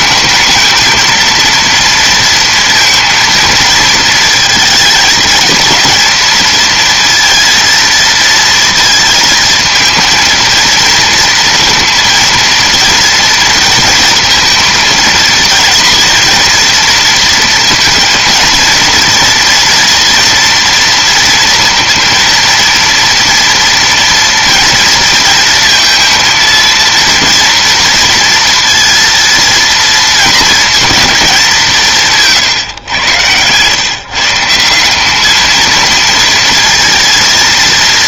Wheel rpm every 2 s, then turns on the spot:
220, 230, 230, 230, 230, 230, 230, 230, 230, 230, 230, 230, 230, 230, 230, 220, 130, 160, 230.
none